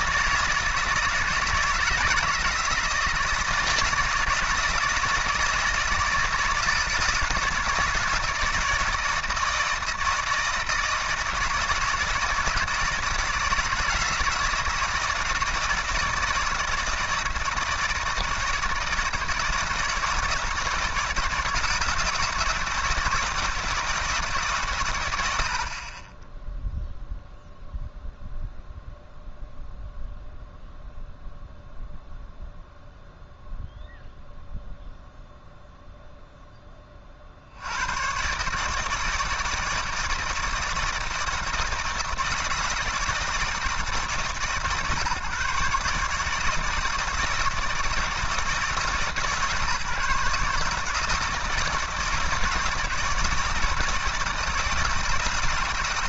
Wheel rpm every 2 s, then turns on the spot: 160, 160, 160, 160, 160, 160, 160, 160, 160, 160, 160, 160, 130, 0, 0, 0, 0, 0, 10, 150, 160, 160, 140, 160, 150, 150, 160, 160.
none